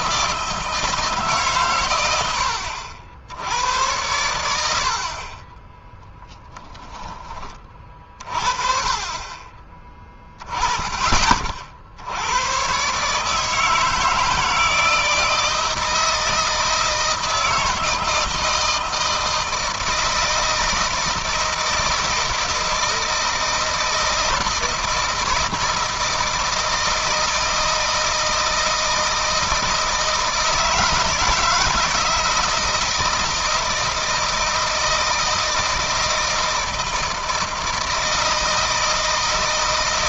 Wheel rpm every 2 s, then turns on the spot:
160, 60, 70, 10, 40, 20, 130, 160, 160, 160, 160, 160, 160, 160, 160, 170, 160, 170, 160, 160.
none